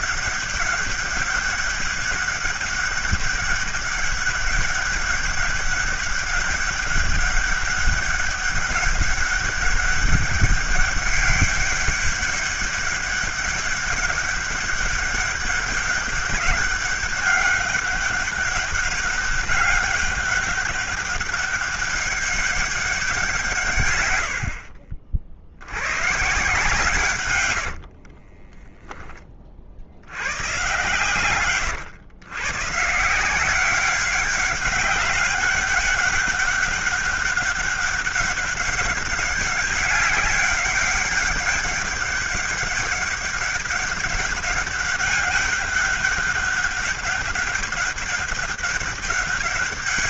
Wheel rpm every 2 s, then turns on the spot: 200, 200, 200, 200, 200, 200, 200, 200, 200, 200, 200, 200, 60, 140, 10, 120, 130, 200, 200, 200, 200, 200, 200, 190, 200.
24-26 28-30